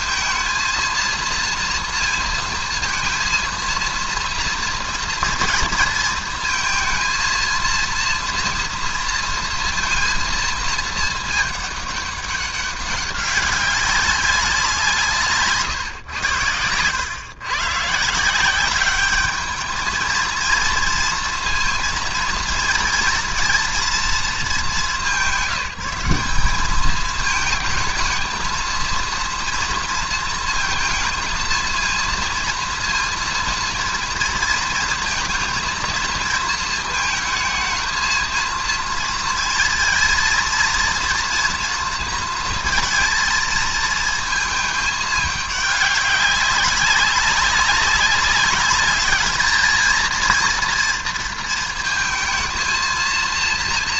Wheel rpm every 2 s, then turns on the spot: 230, 230, 230, 230, 240, 230, 200, 190, 100, 180, 230, 230, 210, 200, 230, 220, 230, 230, 220, 230, 230, 230, 220, 200, 200, 230, 230.
none